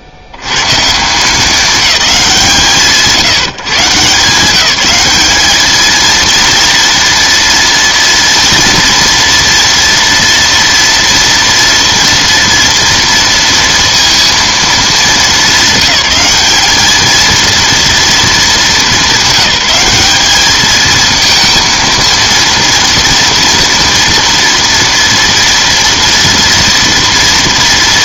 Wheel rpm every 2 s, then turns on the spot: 100, 160, 200, 230, 230, 230, 230, 230, 210, 210, 210, 230, 230, 230.
none